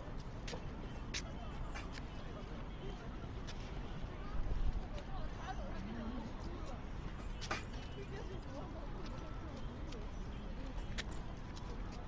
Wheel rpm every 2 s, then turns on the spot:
0, 0, 0, 0, 0, 0.
none